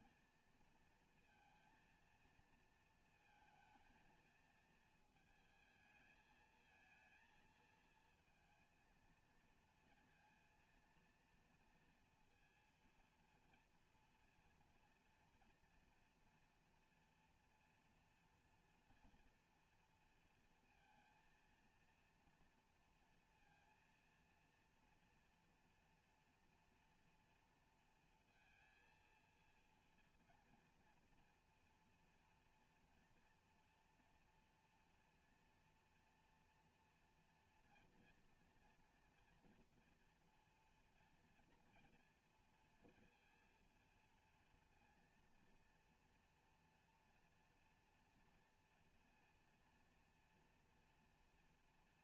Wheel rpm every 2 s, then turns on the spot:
230, 230, 230, 220, 230, 230, 230, 230, 230, 230, 230, 240, 230, 230, 230, 230, 230, 240, 240, 230, 230, 230, 230, 230, 230, 230.
none